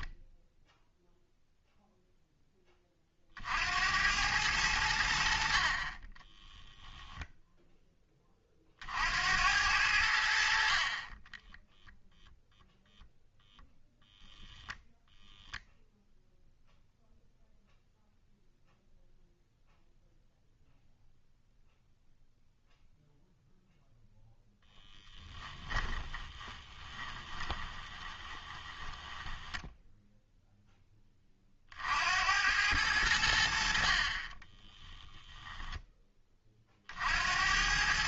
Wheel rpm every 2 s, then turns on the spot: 0, 30, 90, 0, 50, 40, 0, 0, 0, 0, 0, 0, 10, 20, 10, 10, 90, 20, 50.
24-30 34-36